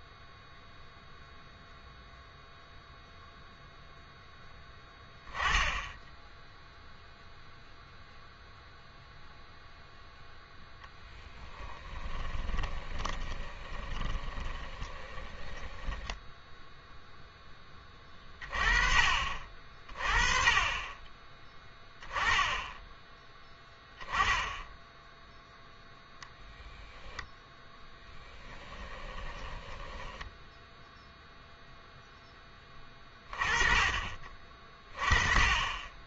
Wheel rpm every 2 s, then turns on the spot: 0, 0, 10, 0, 0, 10, 20, 20, 0, 30, 30, 10, 0, 10, 10, 10, 20, 30.
12-16 28-32